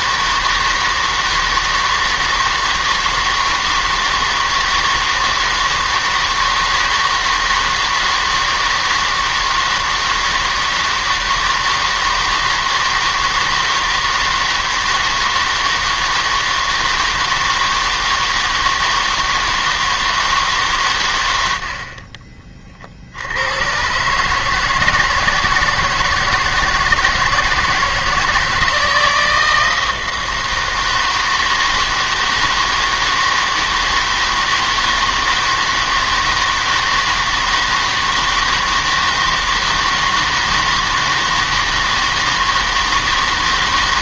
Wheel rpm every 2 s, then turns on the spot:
160, 160, 160, 160, 160, 160, 160, 160, 160, 160, 140, 40, 160, 160, 160, 160, 160, 160, 160, 160, 160, 160.
none